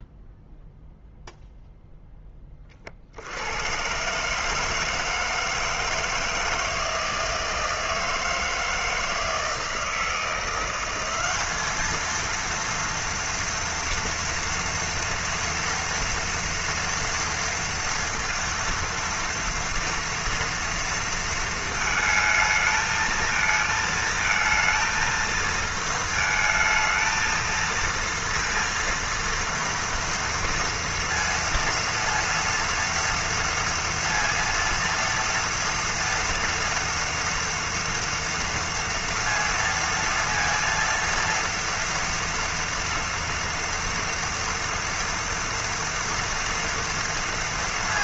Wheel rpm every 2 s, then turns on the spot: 0, 10, 140, 160, 160, 170, 230, 230, 230, 230, 230, 220, 230, 220, 230, 230, 230, 230, 230, 230, 230, 230, 230, 230.
none